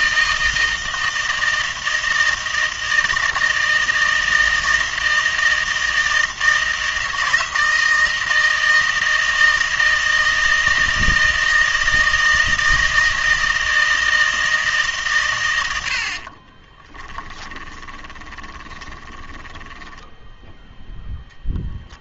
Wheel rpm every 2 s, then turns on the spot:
160, 160, 160, 160, 160, 160, 160, 160, 30, 20, 10.
16-20